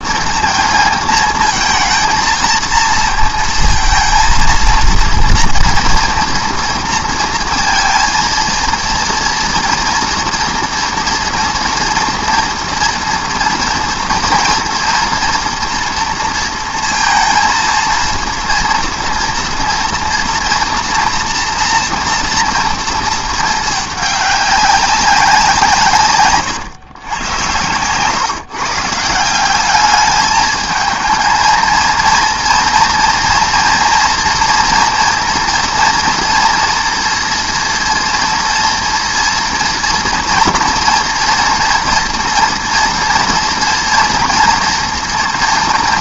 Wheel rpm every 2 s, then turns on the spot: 220, 230, 230, 230, 230, 230, 230, 240, 230, 230, 230, 230, 200, 130, 150, 220, 230, 240, 240, 230, 230, 230, 230.
none